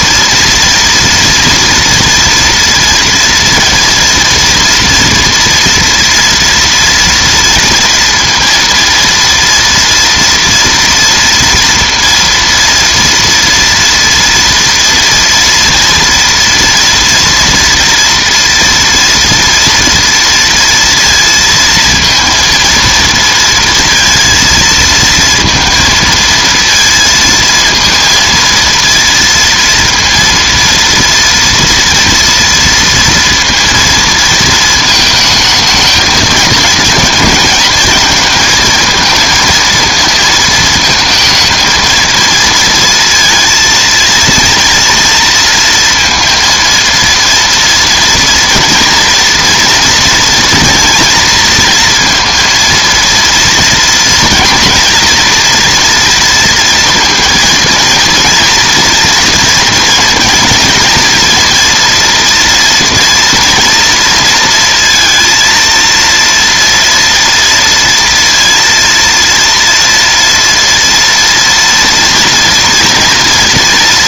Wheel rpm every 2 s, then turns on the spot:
230, 230, 230, 230, 230, 230, 230, 240, 240, 230, 230, 230, 230, 230, 230, 230, 230, 220, 220, 220, 220, 230, 230, 230, 230, 240, 230, 230, 230, 240, 230, 230, 230, 230, 230, 230, 240.
none